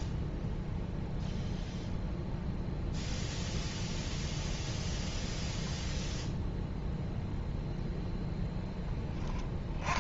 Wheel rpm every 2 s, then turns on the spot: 0, 0, 10, 0, 10.
none